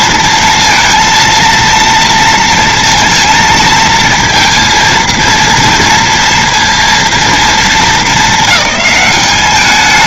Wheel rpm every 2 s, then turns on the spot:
230, 230, 230, 230, 200.
none